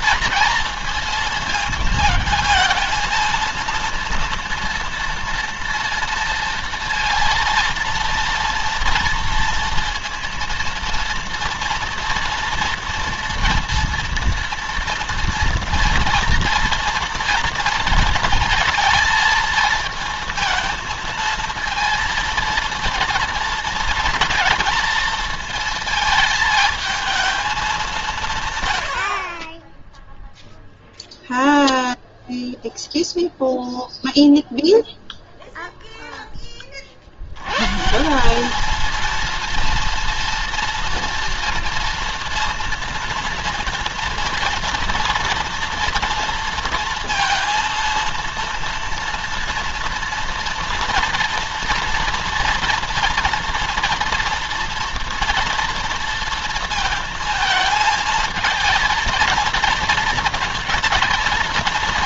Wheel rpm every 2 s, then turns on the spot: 230, 220, 240, 230, 240, 230, 230, 230, 230, 230, 220, 230, 220, 220, 140, 0, 0, 0, 20, 200, 240, 230, 230, 230, 230, 240, 230, 230, 230, 230, 230.
none